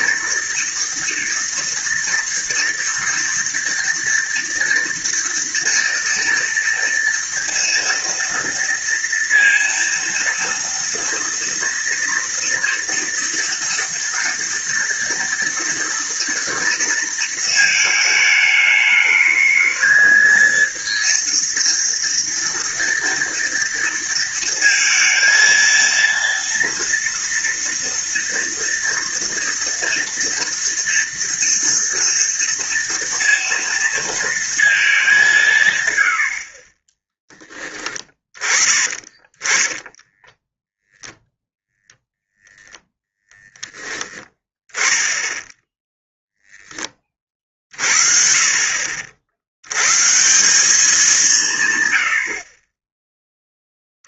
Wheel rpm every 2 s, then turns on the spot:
230, 230, 230, 230, 230, 230, 230, 230, 230, 210, 230, 230, 230, 230, 230, 230, 230, 210, 20, 20, 0, 0, 10, 20, 60, 190, 30.
none